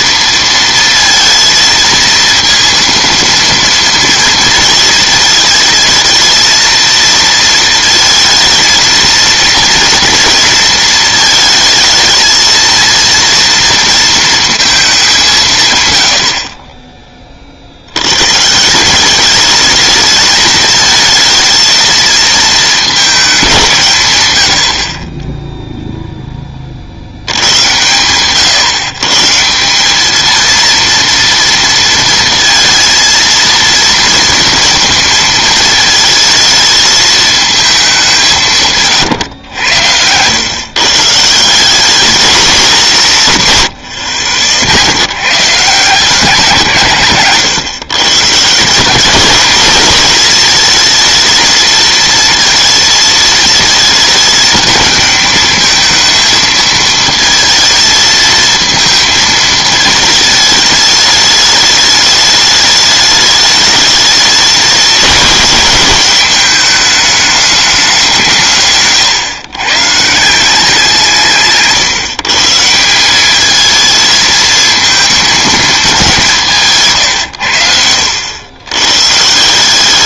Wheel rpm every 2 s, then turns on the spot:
230, 230, 220, 230, 230, 230, 230, 210, 20, 180, 220, 210, 50, 60, 140, 230, 230, 230, 220, 150, 140, 190, 90, 150, 180, 220, 220, 220, 220, 230, 220, 210, 210, 210, 140, 180, 170, 220, 150, 120.
none